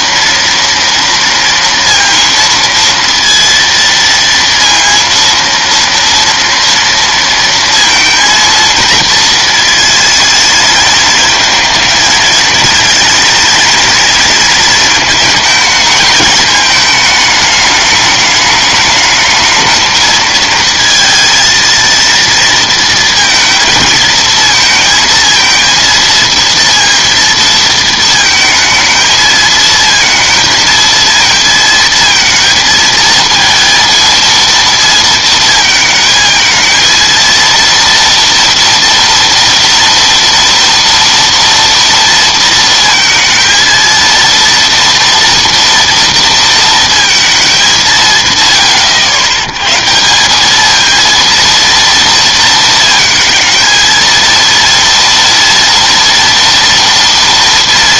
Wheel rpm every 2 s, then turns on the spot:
230, 230, 230, 230, 230, 220, 230, 230, 220, 210, 230, 230, 230, 230, 220, 230, 230, 230, 220, 240, 230, 230, 230, 230, 120, 190, 230, 230, 230.
none